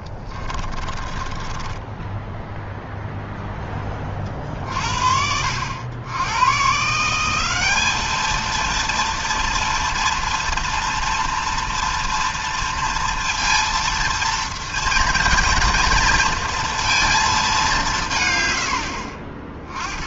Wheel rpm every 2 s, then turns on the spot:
30, 0, 50, 130, 230, 230, 230, 230, 230, 80.
0-2